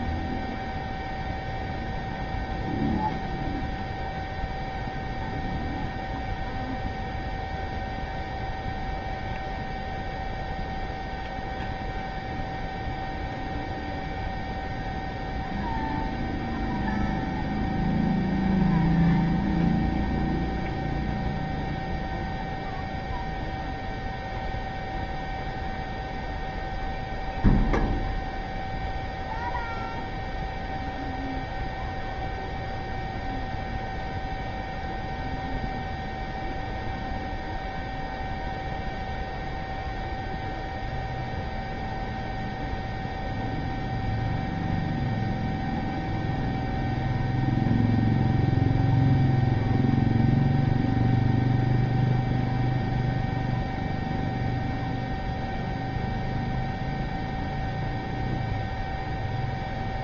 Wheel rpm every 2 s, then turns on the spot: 0, 0, 0, 0, 0, 0, 0, 0, 0, 0, 0, 0, 0, 0, 0, 0, 0, 0, 0, 0, 0, 0, 0, 0, 0, 0, 0, 0, 0, 0.
none